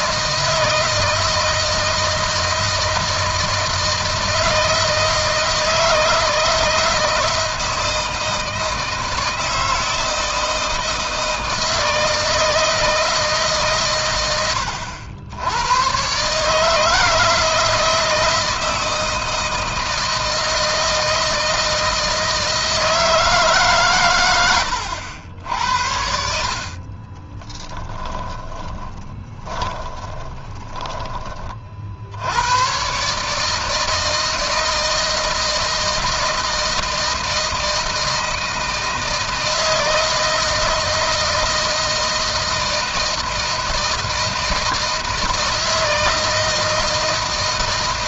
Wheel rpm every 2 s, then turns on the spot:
160, 160, 160, 160, 160, 160, 160, 90, 160, 160, 160, 160, 100, 30, 10, 20, 130, 160, 160, 160, 160, 160, 160, 160.
26-30